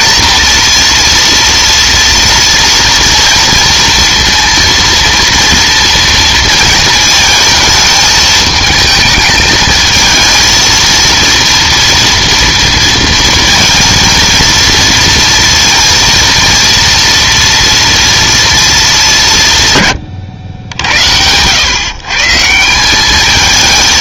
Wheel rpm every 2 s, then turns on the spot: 230, 230, 230, 230, 220, 230, 230, 230, 230, 220, 90, 160.
none